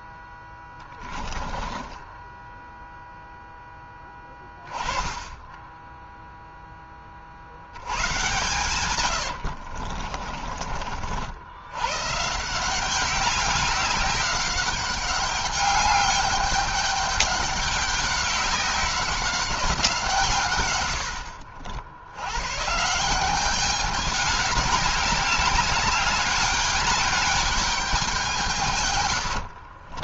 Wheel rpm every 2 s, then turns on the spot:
10, 0, 20, 20, 120, 60, 190, 200, 200, 190, 80, 160, 210, 200, 110.
0-2 8-10 28-30